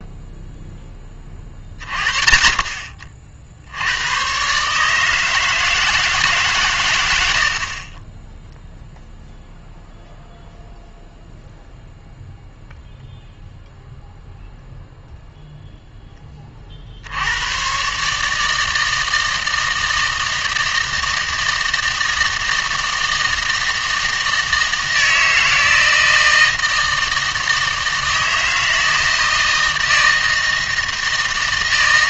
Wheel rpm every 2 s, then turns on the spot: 0, 50, 140, 130, 0, 0, 0, 0, 50, 160, 160, 160, 160, 160, 160, 160.
none